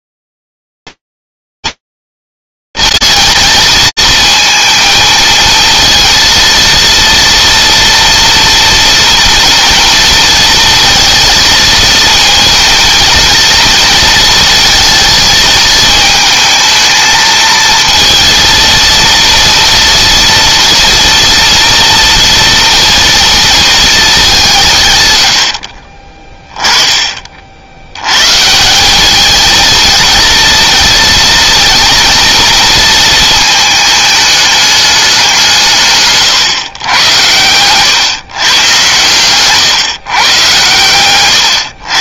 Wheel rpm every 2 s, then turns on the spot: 230, 230, 230, 230, 230, 230, 230, 230, 220, 230, 230, 230, 210, 50, 100, 230, 230, 210, 140, 130, 130.
36-38